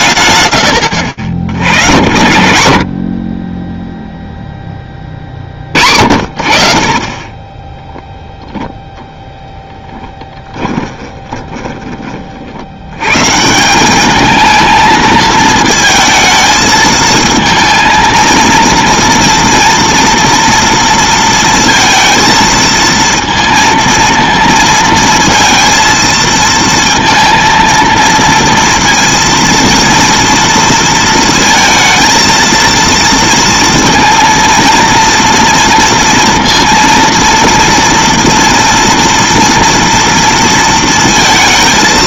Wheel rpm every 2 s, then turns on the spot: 120, 40, 20, 40, 0, 10, 90, 220, 220, 230, 230, 230, 230, 230, 230, 230, 230, 230, 230, 240, 230.
10-12